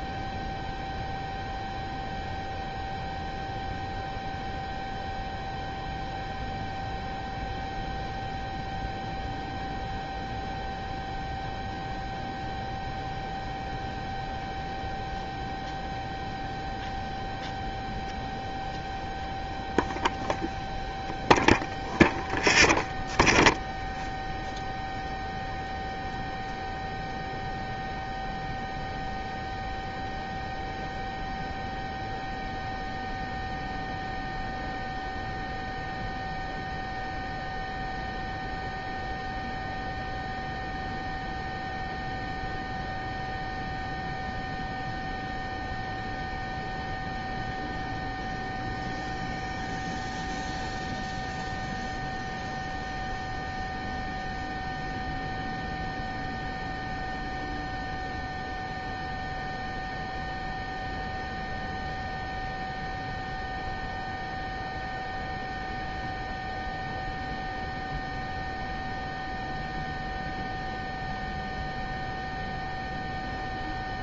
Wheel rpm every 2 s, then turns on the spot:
0, 0, 0, 0, 0, 0, 0, 0, 0, 0, 0, 0, 0, 0, 0, 0, 0, 0, 0, 0, 0, 0, 0, 0, 0, 0, 0, 0, 0, 0, 0, 0, 0, 0, 0, 0, 0.
none